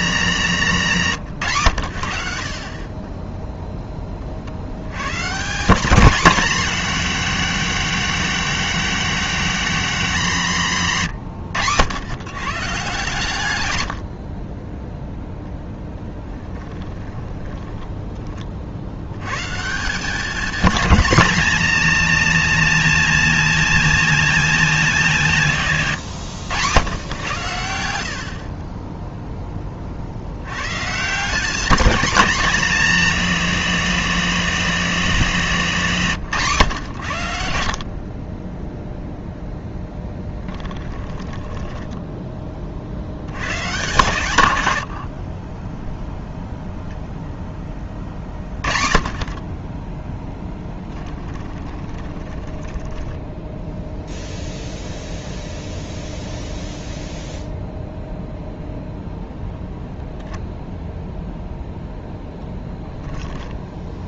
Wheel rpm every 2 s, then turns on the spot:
160, 30, 100, 230, 230, 170, 140, 10, 20, 70, 220, 220, 210, 110, 10, 140, 220, 210, 120, 0, 10, 60, 80, 0, 30, 10, 20, 0, 0, 0, 0, 10.
16-18 40-42 44-46 50-54 62-64